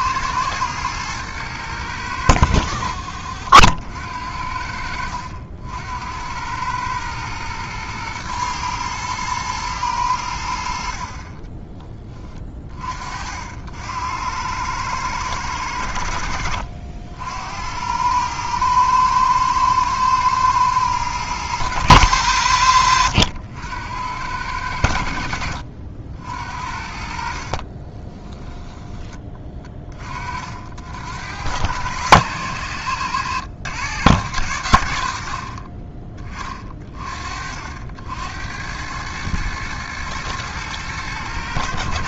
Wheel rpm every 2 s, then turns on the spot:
110, 90, 70, 100, 110, 70, 30, 100, 70, 110, 110, 80, 80, 60, 10, 60, 110, 100, 30, 90, 110.
none